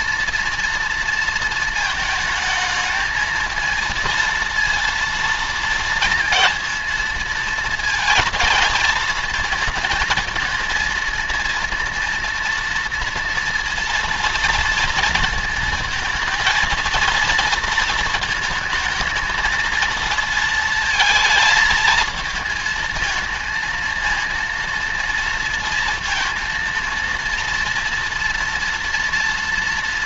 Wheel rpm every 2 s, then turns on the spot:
230, 220, 230, 230, 230, 230, 230, 230, 230, 220, 220, 220, 230, 230, 230.
none